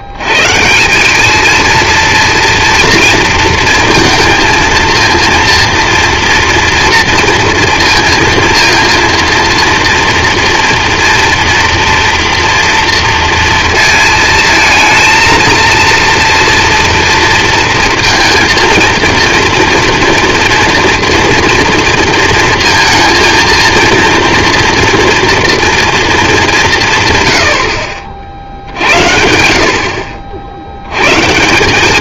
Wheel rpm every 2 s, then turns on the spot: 160, 230, 230, 240, 230, 230, 230, 230, 230, 230, 230, 230, 240, 190, 50, 70.
none